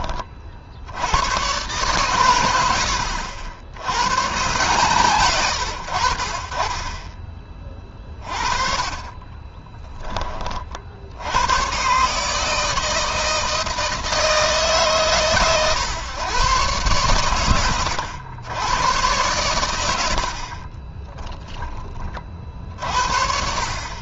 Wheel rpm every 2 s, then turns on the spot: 80, 90, 140, 20, 30, 70, 160, 140, 120, 110, 20, 60.
8-10 20-22